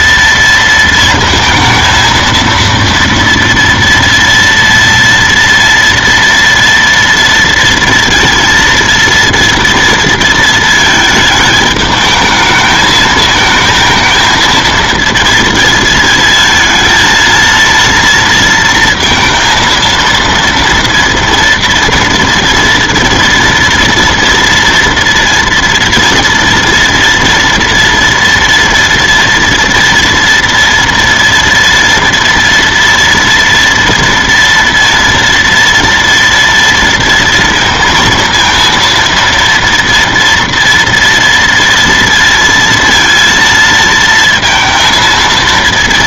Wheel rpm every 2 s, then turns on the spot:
230, 230, 240, 230, 230, 220, 220, 230, 230, 230, 230, 230, 230, 230, 230, 230, 230, 230, 230, 230, 230, 230, 230.
none